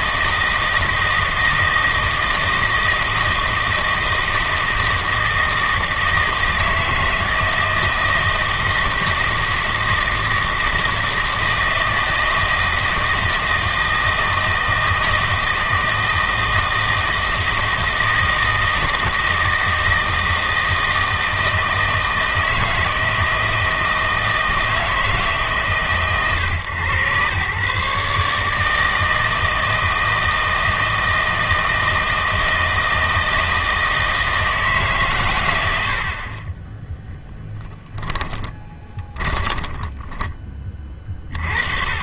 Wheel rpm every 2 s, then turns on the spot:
160, 160, 160, 160, 160, 160, 160, 160, 160, 160, 160, 160, 160, 110, 160, 160, 160, 150, 20, 20, 30.
38-40